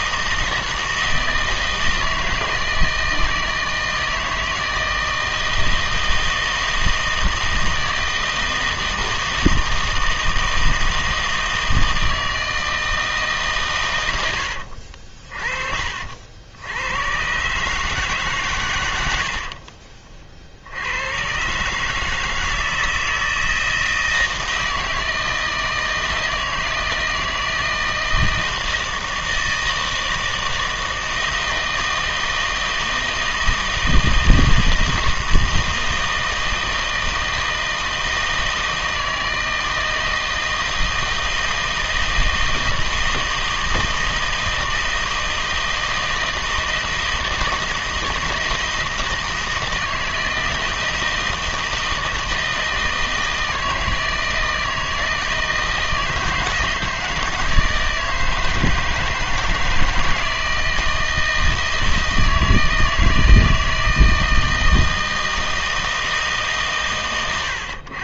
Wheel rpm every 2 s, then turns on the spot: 160, 160, 160, 160, 160, 160, 160, 80, 90, 100, 70, 160, 160, 160, 160, 160, 160, 160, 160, 160, 160, 160, 160, 160, 160, 160, 160, 160, 160, 160, 160, 160, 160, 140.
14-16